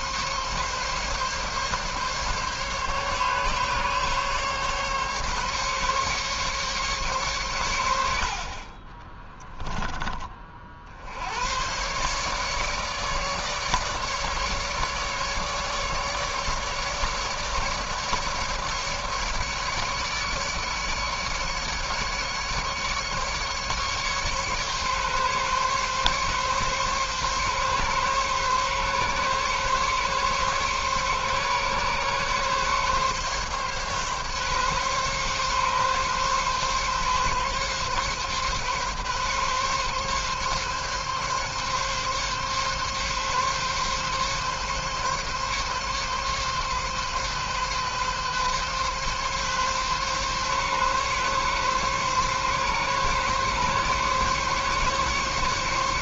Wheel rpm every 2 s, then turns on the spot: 140, 140, 140, 140, 30, 60, 150, 150, 150, 150, 150, 150, 140, 140, 140, 140, 140, 140, 140, 140, 140, 140, 140, 140, 140, 140, 140, 140.
8-10